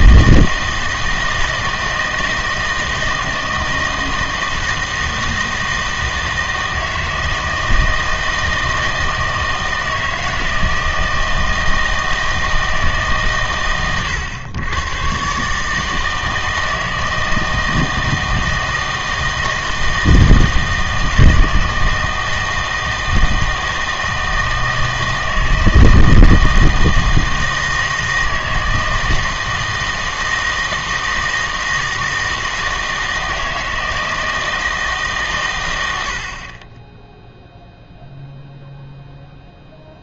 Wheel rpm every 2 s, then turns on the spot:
160, 160, 160, 160, 160, 160, 160, 110, 160, 160, 160, 160, 160, 160, 160, 160, 160, 160, 20, 0.
none